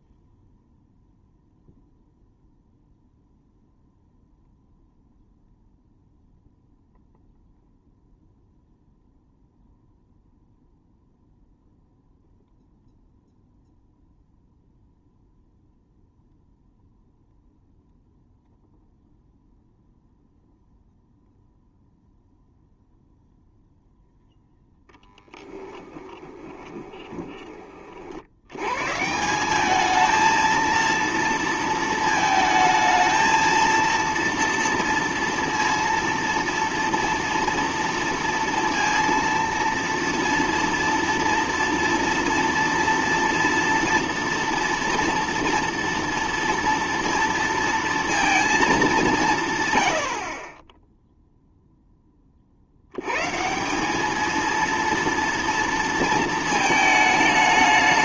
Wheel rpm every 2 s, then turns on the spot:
0, 0, 0, 0, 0, 0, 0, 0, 0, 0, 0, 0, 0, 20, 120, 230, 220, 230, 230, 230, 230, 230, 230, 230, 220, 30, 50, 230, 220.
26-28